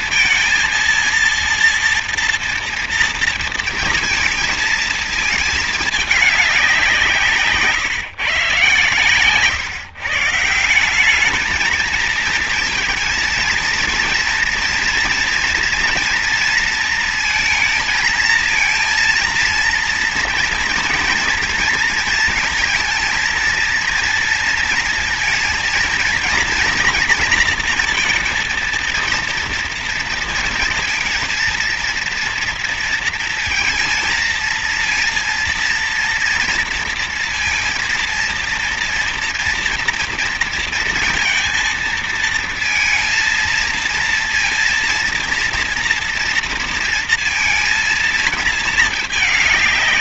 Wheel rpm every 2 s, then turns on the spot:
230, 230, 220, 200, 130, 170, 220, 230, 230, 230, 230, 220, 230, 230, 230, 230, 230, 230, 230, 230, 230, 230, 230, 230, 220.
none